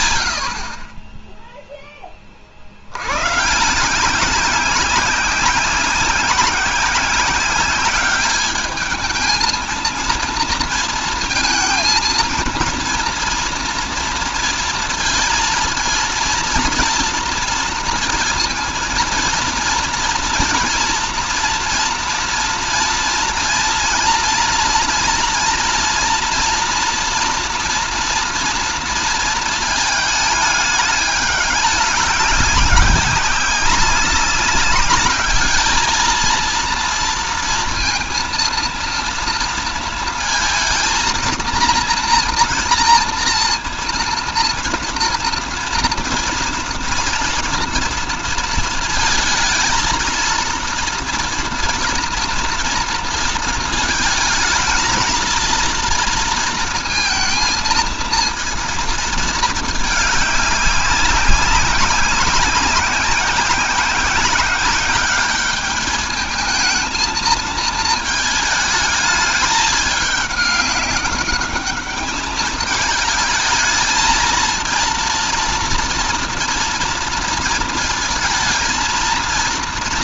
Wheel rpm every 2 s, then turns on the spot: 30, 70, 190, 180, 210, 230, 230, 230, 230, 230, 230, 230, 240, 240, 230, 210, 200, 200, 230, 230, 230, 240, 230, 230, 230, 230, 230, 220, 230, 230, 200, 190, 200, 220, 220, 200, 210, 230, 230, 230.
none